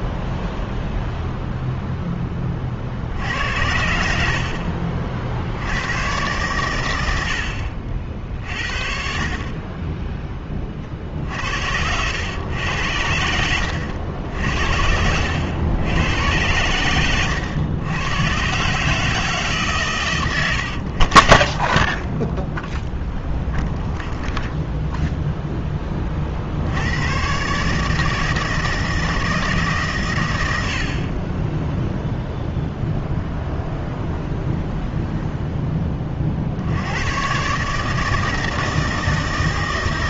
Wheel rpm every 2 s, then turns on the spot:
0, 70, 80, 70, 40, 70, 90, 90, 110, 140, 40, 0, 10, 140, 160, 20, 0, 0, 120, 160.
2-4 12-14